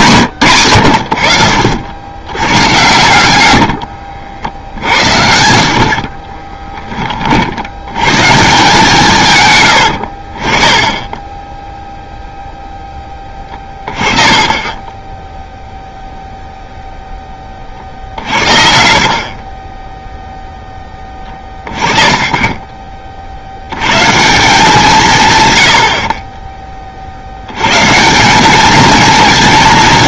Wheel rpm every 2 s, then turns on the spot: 100, 100, 60, 20, 150, 20, 10, 20, 0, 40, 10, 40, 190, 20, 210.
10-12 14-16 18-20